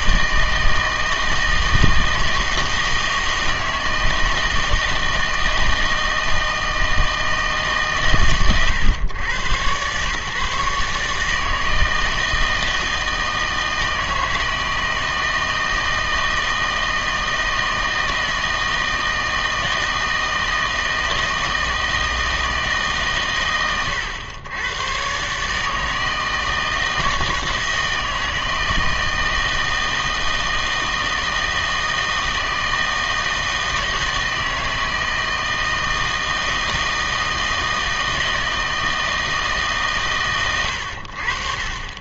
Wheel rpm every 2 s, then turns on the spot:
160, 160, 160, 160, 120, 150, 160, 160, 160, 160, 160, 160, 110, 160, 160, 160, 160, 160, 160, 160, 110.
none